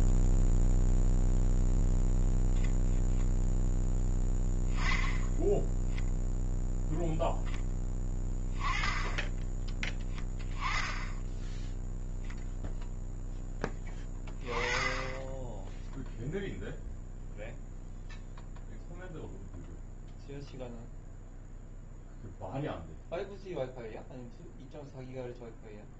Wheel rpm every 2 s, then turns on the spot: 0, 0, 10, 0, 10, 20, 0, 20, 0, 0, 0, 0, 0.
none